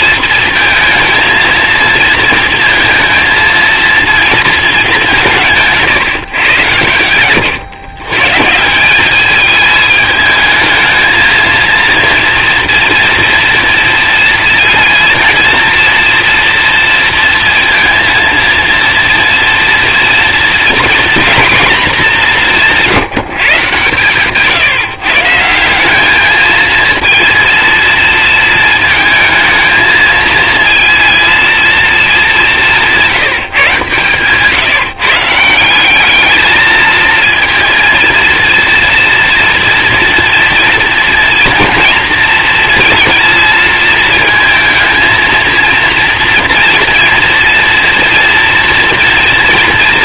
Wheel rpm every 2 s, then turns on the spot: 230, 230, 190, 100, 190, 220, 230, 230, 230, 230, 240, 180, 150, 230, 220, 230, 180, 160, 220, 230, 230, 230, 230, 230, 240.
none